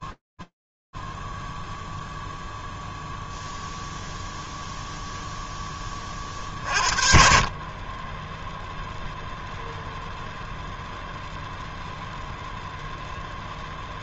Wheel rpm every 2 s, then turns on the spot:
0, 0, 50, 0, 0, 0, 80.
none